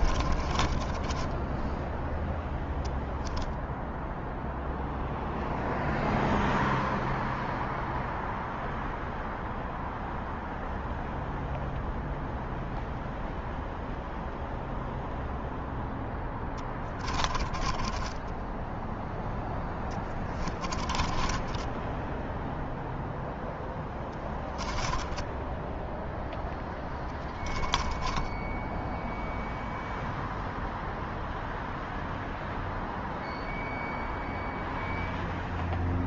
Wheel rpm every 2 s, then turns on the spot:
10, 0, 0, 0, 0, 0, 0, 0, 30, 10, 20, 0, 10, 10, 0, 0, 0, 0.
0-2 16-18 20-22 24-28